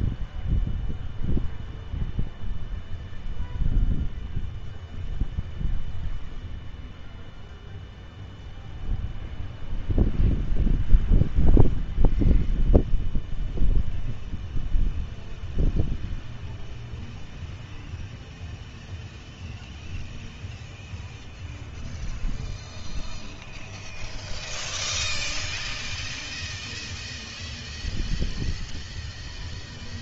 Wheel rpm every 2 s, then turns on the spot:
0, 0, 0, 0, 0, 0, 0, 0, 0, 0, 0, 0, 0, 0, 0.
none